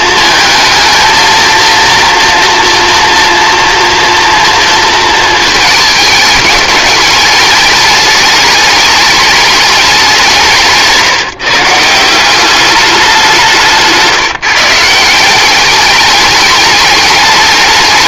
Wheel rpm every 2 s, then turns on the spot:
230, 230, 230, 210, 210, 160, 190, 170, 190.
none